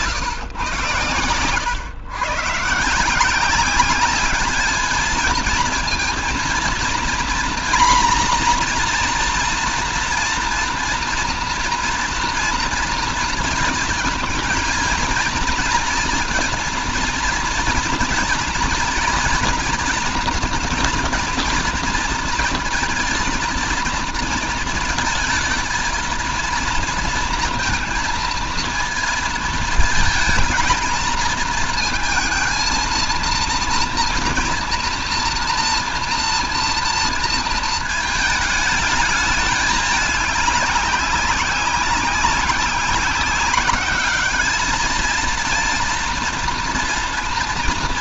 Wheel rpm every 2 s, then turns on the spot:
120, 140, 210, 230, 240, 240, 230, 230, 230, 230, 230, 230, 230, 230, 230, 220, 230, 240, 230, 220, 200, 190, 220, 230.
none